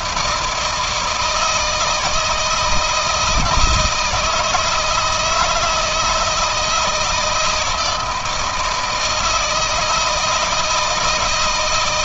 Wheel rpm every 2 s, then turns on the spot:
170, 160, 160, 160, 160, 160.
none